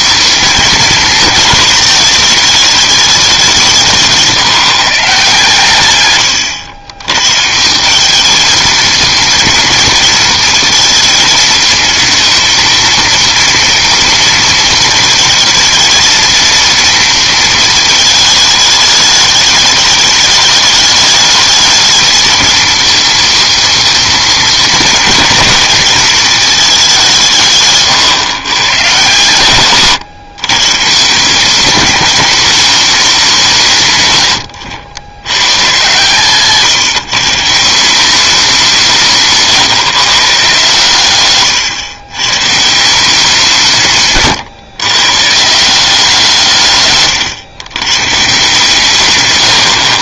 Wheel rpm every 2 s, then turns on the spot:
220, 220, 160, 100, 220, 230, 230, 230, 230, 210, 210, 230, 220, 210, 120, 130, 210, 90, 160, 180, 140, 140, 120, 150, 140.
none